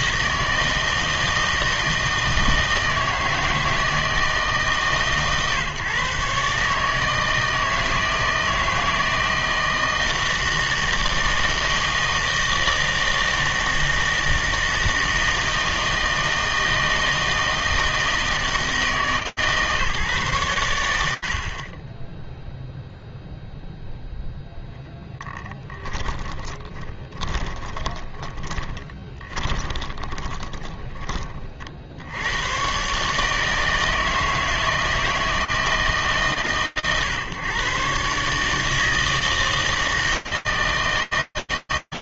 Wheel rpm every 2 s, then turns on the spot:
160, 160, 140, 150, 160, 160, 160, 160, 160, 160, 80, 0, 10, 20, 20, 40, 160, 160, 130, 160, 160.
24-30